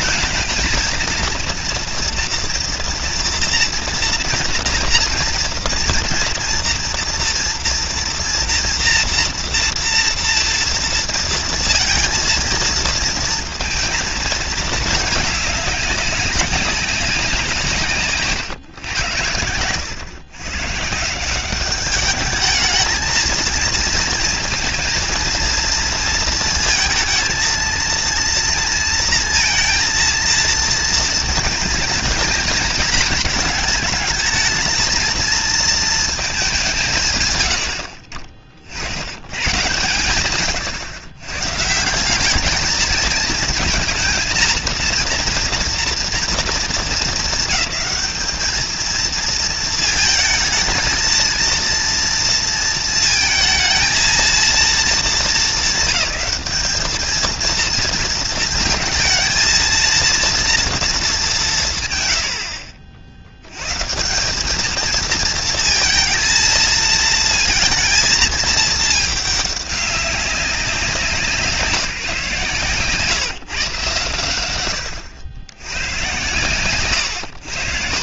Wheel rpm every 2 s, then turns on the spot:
220, 230, 230, 230, 230, 240, 230, 230, 210, 170, 100, 190, 230, 230, 230, 230, 230, 220, 230, 80, 120, 160, 230, 230, 220, 230, 230, 230, 220, 230, 230, 140, 120, 230, 230, 200, 160, 130, 110.
none